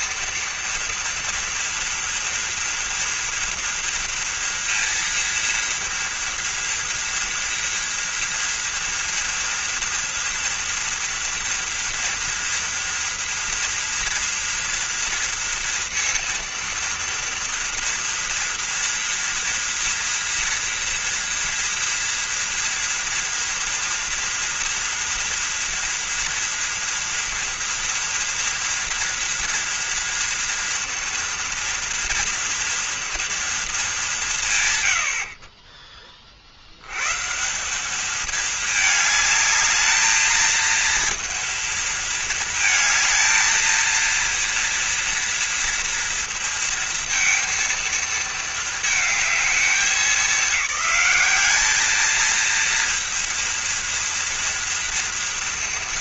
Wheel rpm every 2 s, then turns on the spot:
230, 230, 230, 240, 230, 230, 230, 230, 230, 230, 230, 230, 230, 230, 230, 230, 230, 120, 90, 220, 220, 220, 240, 230, 220, 200, 230, 230.
none